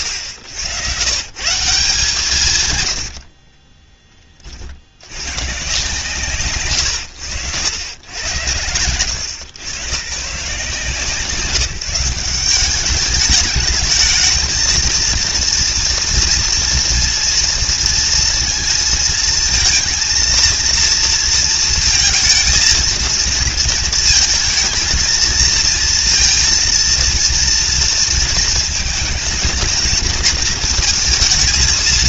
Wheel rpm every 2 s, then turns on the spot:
110, 190, 40, 130, 100, 150, 190, 220, 230, 230, 230, 220, 210, 230, 230, 220.
none